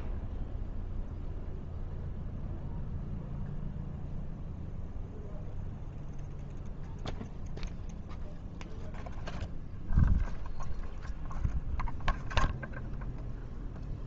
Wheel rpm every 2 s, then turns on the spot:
0, 0, 0, 0, 0, 0, 0.
none